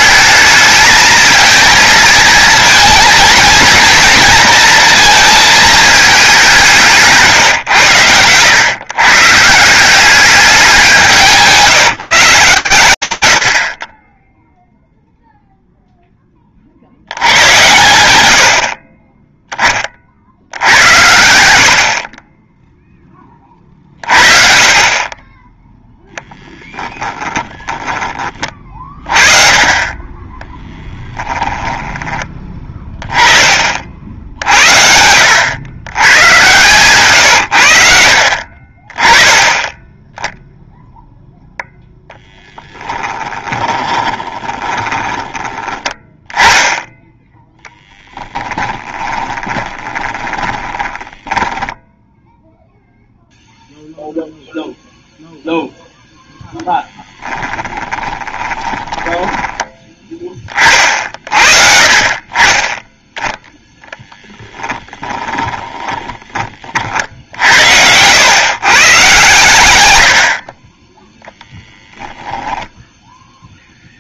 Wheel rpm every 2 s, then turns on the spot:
220, 230, 230, 180, 120, 180, 150, 0, 50, 60, 90, 10, 40, 10, 30, 10, 20, 80, 130, 40, 0, 20, 20, 10, 10, 20, 0, 0, 10, 20, 30, 20, 10, 40, 130, 30, 10.
26-28 30-32 36-38 42-46 48-52 56-60 64-66